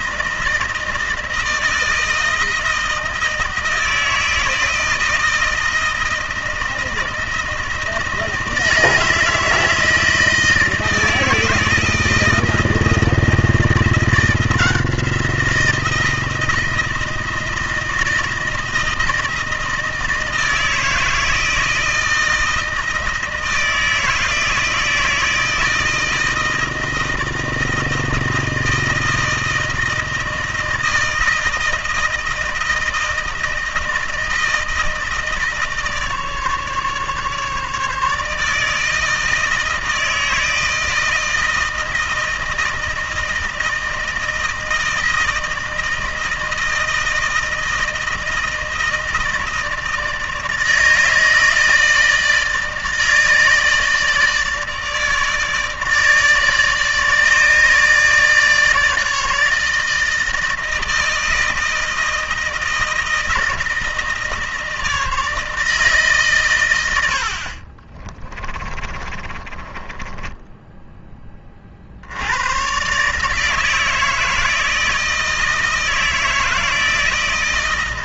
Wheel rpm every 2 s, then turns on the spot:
160, 160, 160, 160, 160, 160, 160, 170, 160, 160, 160, 160, 160, 160, 160, 160, 160, 160, 150, 160, 160, 160, 160, 160, 160, 160, 160, 150, 150, 150, 160, 160, 160, 120, 20, 10, 100, 160, 160.
68-72